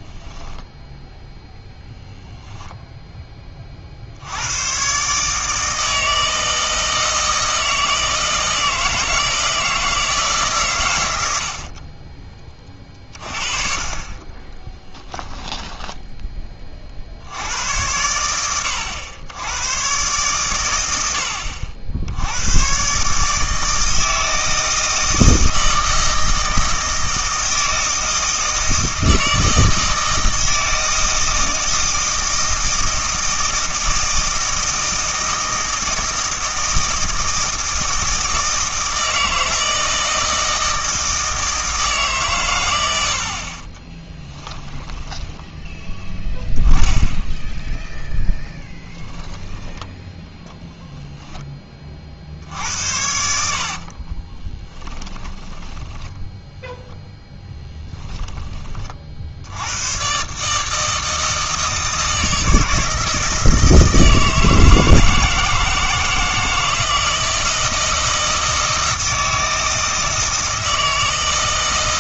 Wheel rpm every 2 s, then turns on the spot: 0, 0, 110, 160, 160, 130, 30, 10, 30, 90, 90, 120, 160, 160, 160, 160, 160, 160, 160, 160, 160, 100, 10, 10, 10, 0, 70, 10, 0, 20, 150, 160, 160, 160, 160, 160.
14-16 44-46 54-56